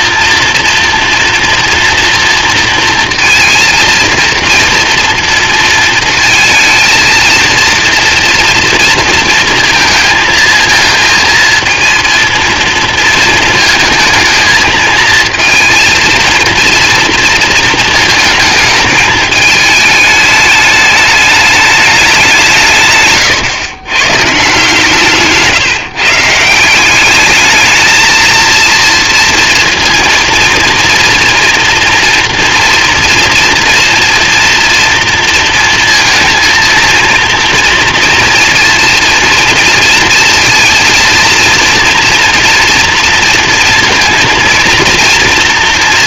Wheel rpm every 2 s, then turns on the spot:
230, 230, 230, 230, 230, 220, 230, 230, 230, 220, 210, 160, 170, 180, 230, 240, 240, 230, 230, 230, 230, 240, 230.
none